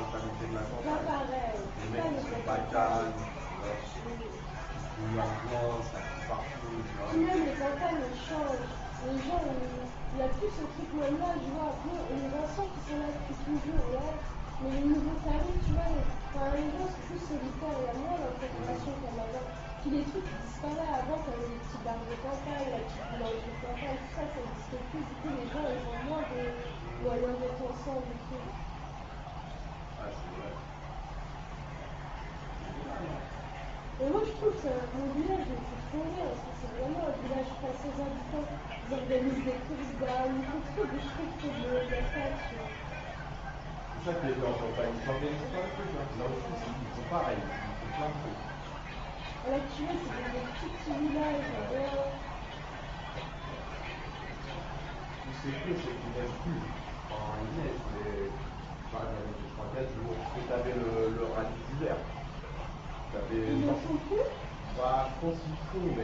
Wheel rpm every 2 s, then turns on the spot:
0, 0, 0, 0, 0, 0, 0, 0, 0, 0, 0, 0, 0, 0, 0, 0, 0, 0, 0, 0, 0, 0, 0, 0, 0, 0, 0, 0, 0, 0, 0, 0, 0.
none